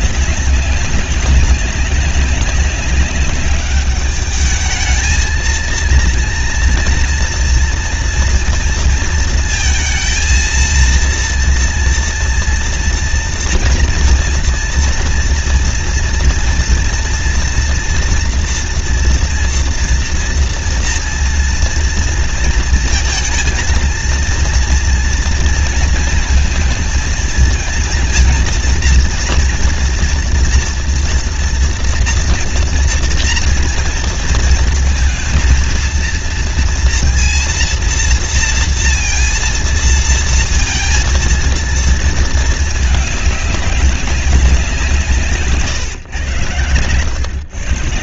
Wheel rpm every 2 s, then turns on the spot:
200, 200, 210, 230, 230, 230, 230, 230, 240, 230, 230, 230, 230, 230, 230, 240, 230, 230, 230, 230, 230, 210, 180, 110.
none